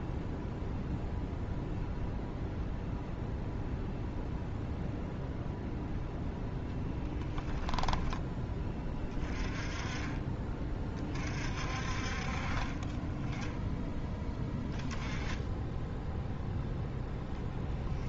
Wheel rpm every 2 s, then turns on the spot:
0, 0, 0, 0, 20, 30, 20, 10, 0.
none